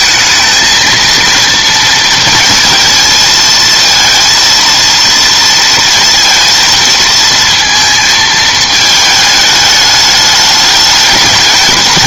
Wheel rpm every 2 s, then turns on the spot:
220, 220, 230, 230, 220, 210.
none